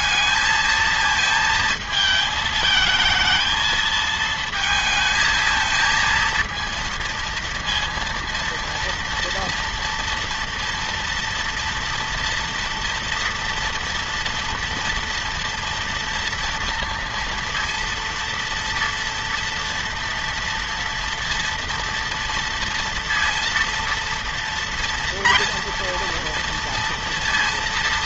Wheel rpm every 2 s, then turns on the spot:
210, 220, 230, 230, 230, 230, 240, 230, 230, 230, 230, 230, 230, 230.
none